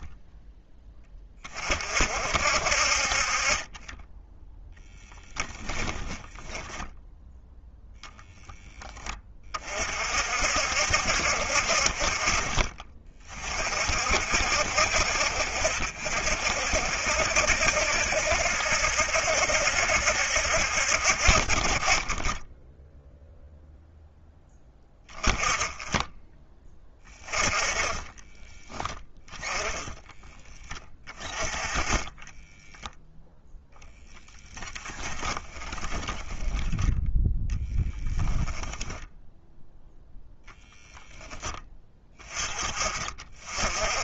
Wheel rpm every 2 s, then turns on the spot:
20, 40, 10, 0, 30, 40, 40, 60, 60, 70, 40, 0, 10, 20, 10, 20, 0, 20, 10, 0, 10, 20.
26-32 34-38